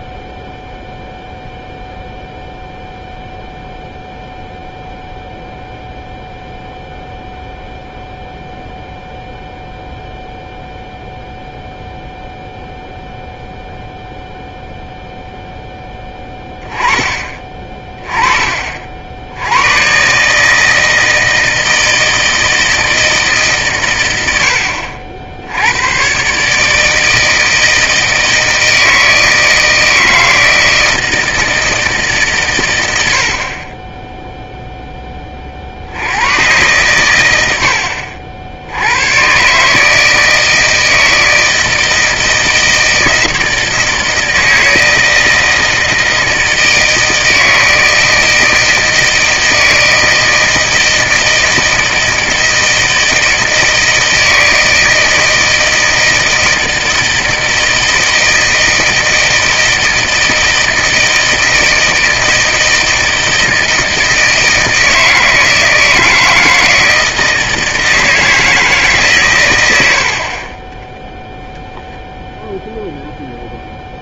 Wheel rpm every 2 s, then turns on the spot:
0, 0, 0, 0, 0, 0, 0, 0, 10, 50, 160, 160, 80, 150, 160, 160, 100, 10, 120, 80, 160, 160, 160, 160, 160, 160, 160, 160, 160, 160, 160, 160, 160, 160, 160, 20, 0.
none